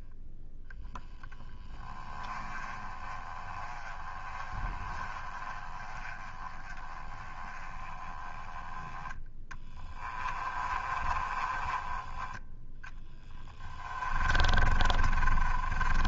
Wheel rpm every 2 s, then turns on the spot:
0, 20, 20, 20, 10, 20, 10, 30.
10-16